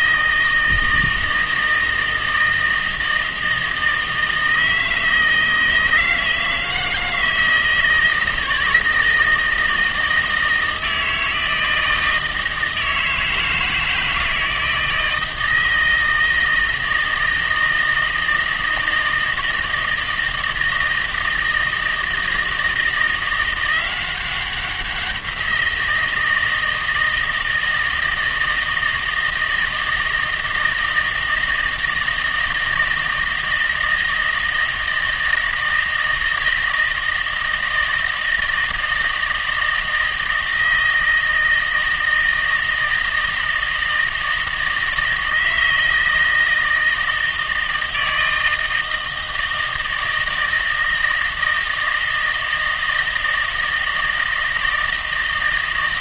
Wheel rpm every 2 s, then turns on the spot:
160, 160, 160, 160, 160, 160, 160, 160, 160, 160, 160, 160, 180, 160, 160, 160, 160, 160, 160, 160, 160, 160, 160, 160, 160, 160, 160, 160.
none